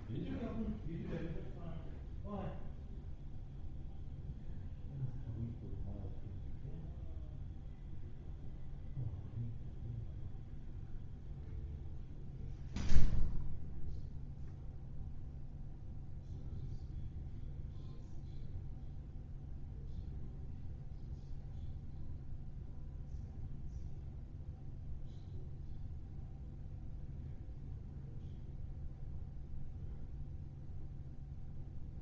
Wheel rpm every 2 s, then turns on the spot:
0, 0, 0, 0, 0, 0, 0, 0, 0, 0, 0, 0, 0, 0, 0, 0.
none